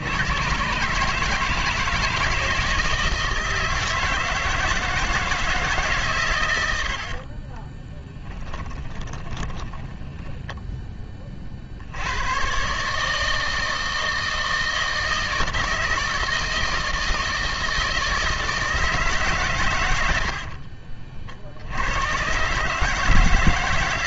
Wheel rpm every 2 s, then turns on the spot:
90, 160, 160, 120, 10, 10, 130, 160, 160, 160, 50, 150.
8-10 20-22